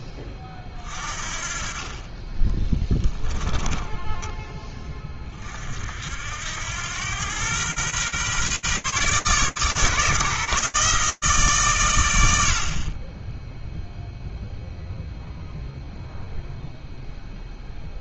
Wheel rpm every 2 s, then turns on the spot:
30, 10, 20, 90, 130, 150, 30, 0, 0.
2-4